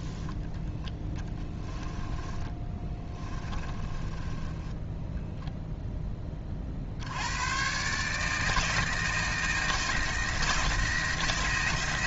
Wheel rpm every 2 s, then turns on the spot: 10, 20, 10, 50, 160, 170.
2-6